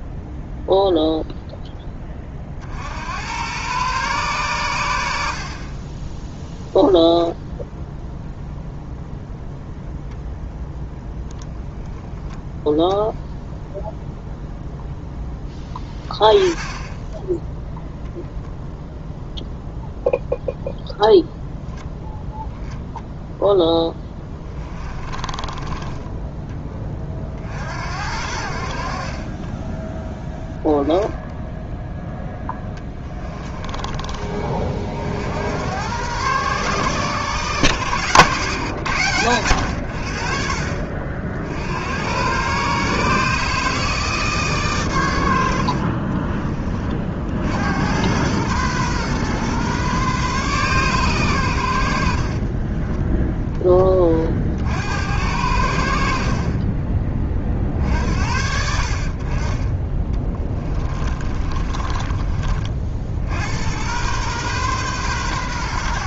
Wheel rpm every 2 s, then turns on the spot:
0, 70, 100, 0, 0, 0, 0, 0, 20, 0, 0, 0, 20, 20, 50, 10, 10, 50, 130, 110, 50, 140, 110, 50, 120, 130, 10, 70, 30, 60, 30, 60, 130.
24-26 32-34 52-54 60-62